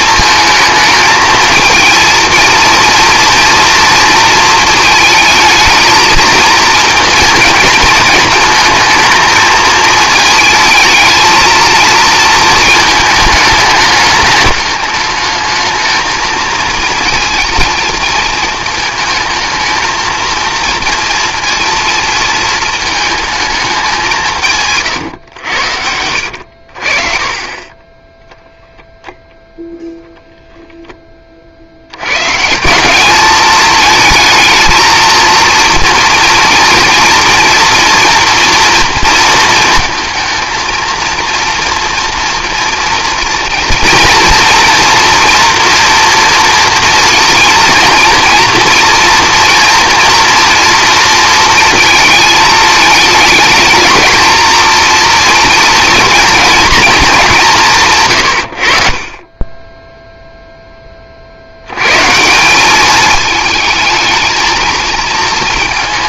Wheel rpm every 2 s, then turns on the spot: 220, 230, 220, 230, 220, 220, 220, 210, 230, 220, 230, 220, 150, 60, 0, 0, 160, 220, 230, 230, 230, 230, 240, 230, 230, 230, 220, 230, 230, 50, 10, 200, 220.
none